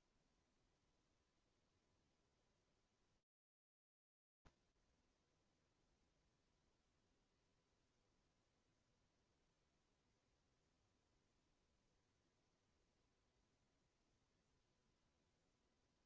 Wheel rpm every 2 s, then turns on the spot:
0, 0, 0, 0, 0, 0, 0, 0.
none